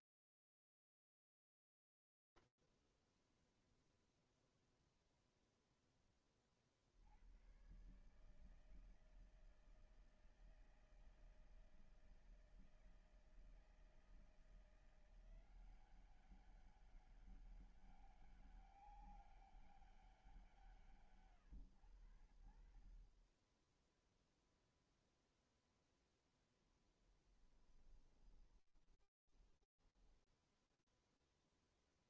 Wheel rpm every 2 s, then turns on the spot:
0, 0, 0, 10, 130, 160, 160, 160, 190, 200, 170, 70, 0, 0, 10, 0.
28-30